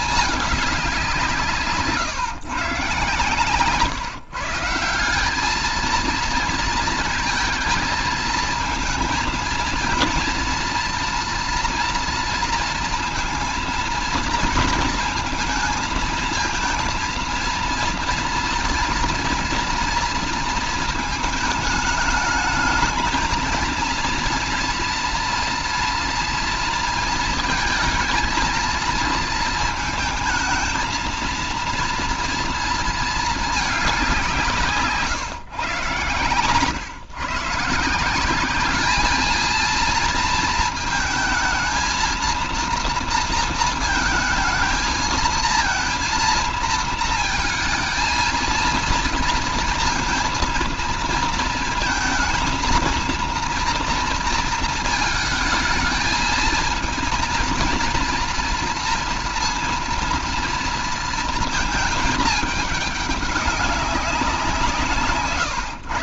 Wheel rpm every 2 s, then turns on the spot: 210, 140, 150, 230, 220, 230, 230, 230, 230, 230, 230, 210, 230, 230, 220, 220, 230, 160, 120, 200, 230, 230, 220, 230, 230, 230, 220, 230, 220, 230, 230, 220, 180.
none